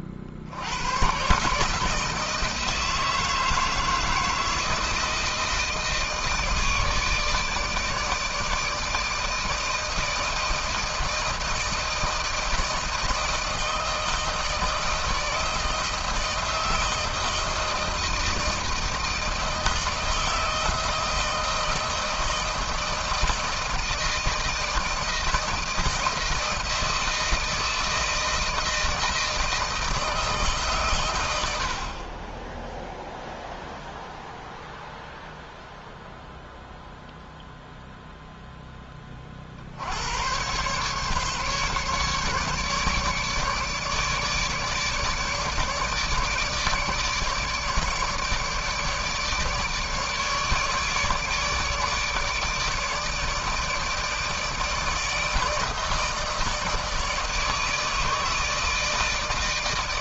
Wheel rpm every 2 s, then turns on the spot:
70, 160, 160, 160, 150, 160, 170, 160, 160, 160, 160, 160, 160, 160, 160, 150, 20, 0, 0, 10, 120, 150, 150, 150, 150, 150, 150, 160, 160, 160.
none